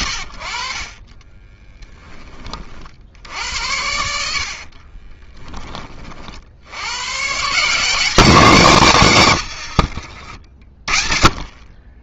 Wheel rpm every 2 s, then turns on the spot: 70, 10, 70, 40, 180, 60.
2-4 10-12